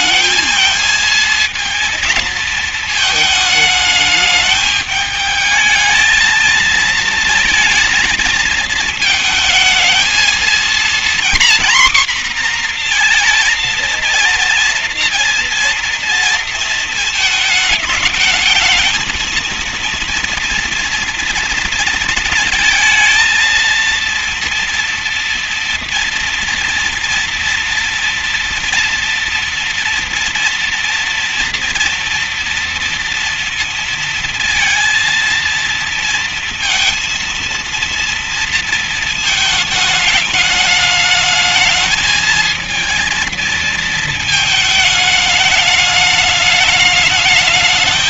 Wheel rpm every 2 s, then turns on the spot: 220, 230, 210, 230, 230, 230, 240, 240, 230, 220, 230, 230, 230, 240, 240, 240, 240, 220, 230, 230, 210, 220, 220, 210.
none